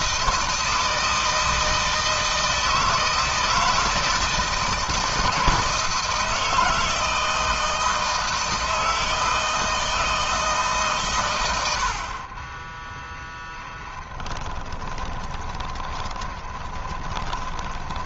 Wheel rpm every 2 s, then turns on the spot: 160, 160, 170, 160, 160, 120, 10, 20, 20.
12-18